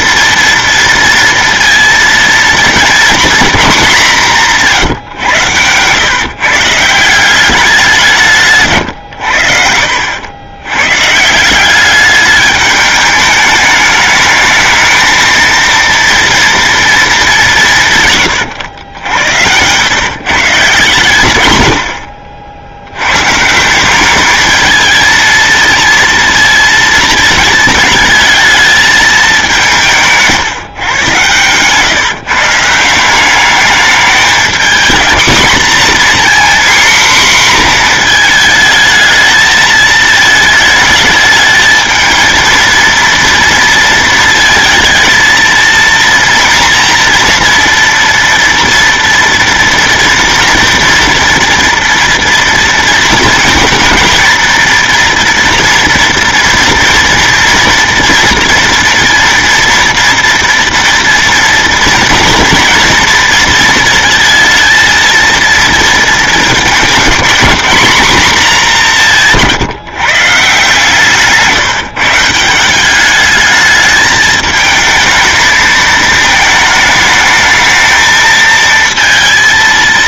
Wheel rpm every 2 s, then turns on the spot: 230, 230, 170, 150, 150, 100, 210, 210, 230, 110, 150, 60, 210, 230, 220, 150, 150, 220, 250, 220, 220, 230, 230, 230, 240, 230, 230, 230, 240, 230, 230, 230, 230, 210, 220, 150, 170, 220, 220, 230.
none